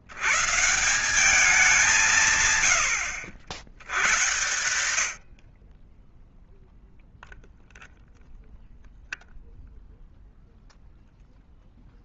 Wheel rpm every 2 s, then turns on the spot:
60, 170, 100, 20, 0, 0.
none